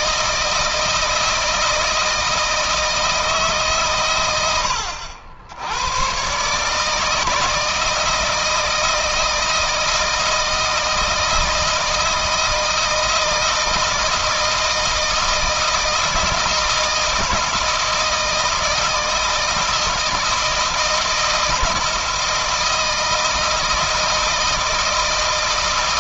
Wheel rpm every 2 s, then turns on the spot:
160, 160, 80, 150, 160, 160, 160, 160, 160, 160, 160, 160, 160.
none